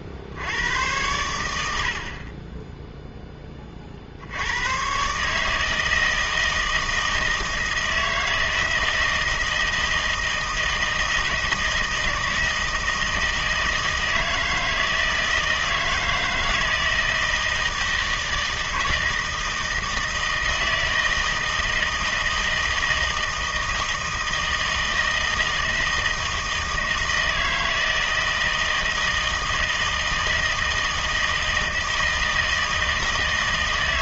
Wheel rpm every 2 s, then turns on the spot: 80, 10, 110, 160, 160, 160, 160, 160, 160, 160, 160, 160, 160, 160, 160, 160, 160.
none